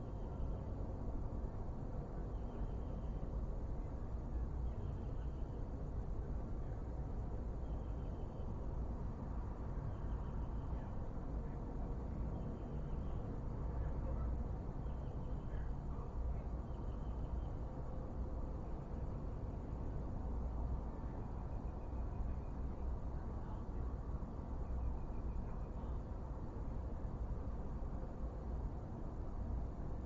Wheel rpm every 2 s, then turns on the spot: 0, 0, 0, 0, 0, 0, 0, 0, 0, 0, 0, 0, 0, 0, 0.
none